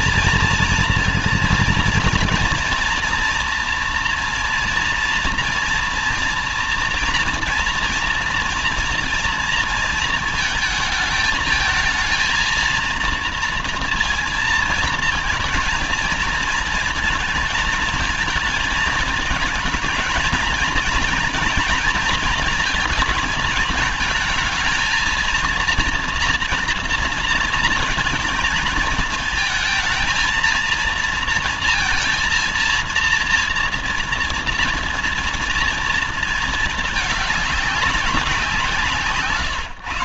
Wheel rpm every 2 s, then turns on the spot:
230, 230, 230, 230, 230, 230, 230, 230, 220, 210, 230, 230, 220, 230, 220, 220, 230, 230, 220, 180.
none